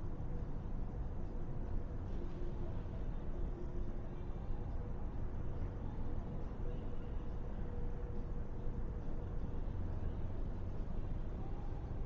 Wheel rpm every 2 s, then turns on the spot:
0, 0, 0, 0, 0, 0.
none